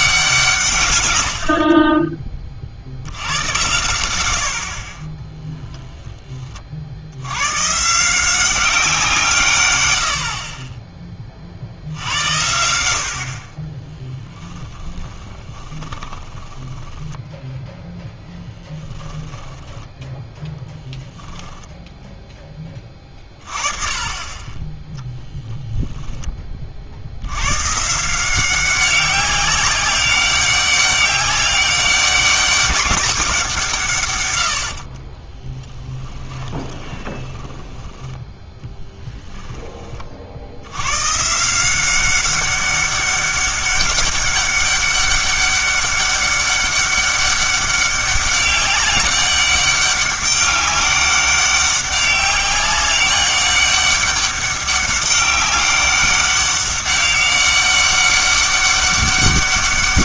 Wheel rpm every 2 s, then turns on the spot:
150, 50, 60, 50, 180, 20, 80, 10, 10, 10, 10, 20, 20, 40, 190, 200, 190, 60, 10, 10, 110, 200, 200, 200, 200, 200, 200, 200, 200, 200.
14-20 34-40